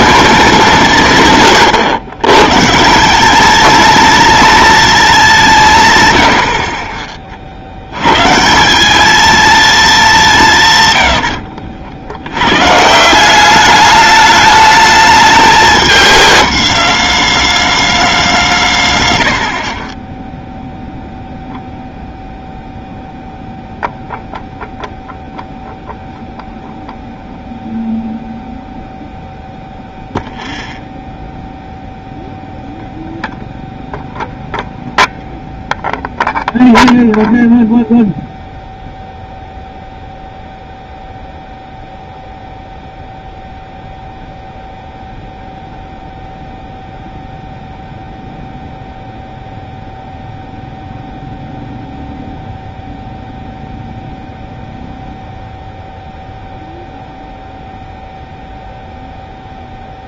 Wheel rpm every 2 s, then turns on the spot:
180, 130, 210, 50, 170, 130, 130, 210, 210, 160, 0, 0, 0, 0, 0, 0, 0, 0, 0, 0, 0, 0, 0, 0, 0, 0, 0, 0, 0, 0.
6-8